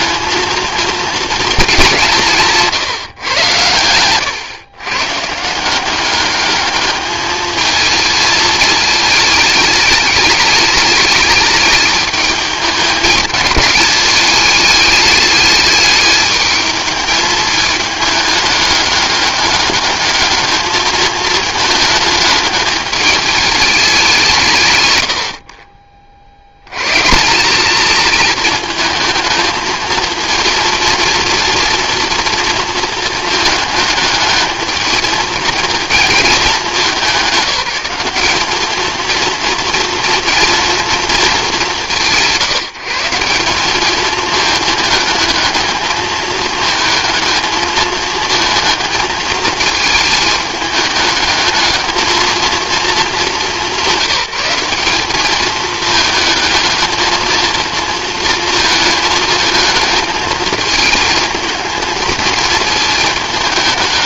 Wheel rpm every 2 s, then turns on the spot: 230, 160, 140, 210, 210, 210, 200, 210, 210, 200, 220, 210, 120, 140, 220, 230, 230, 220, 200, 220, 210, 180, 220, 220, 220, 210, 220, 200, 220, 220, 220, 220.
2-4